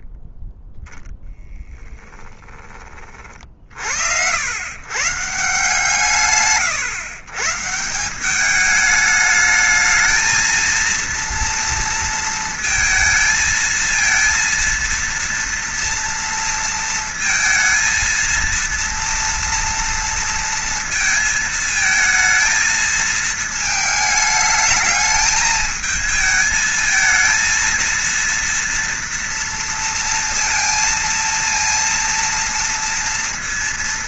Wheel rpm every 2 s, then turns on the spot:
10, 30, 140, 120, 210, 230, 230, 230, 230, 230, 230, 220, 220, 220, 230, 230, 230.
none